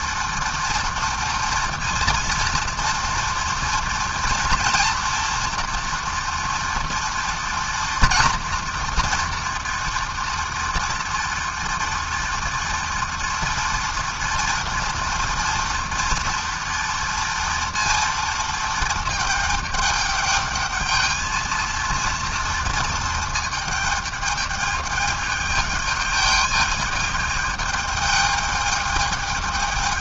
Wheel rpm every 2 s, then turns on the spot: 230, 230, 240, 230, 230, 230, 240, 240, 230, 220, 220, 220, 210, 210, 210.
none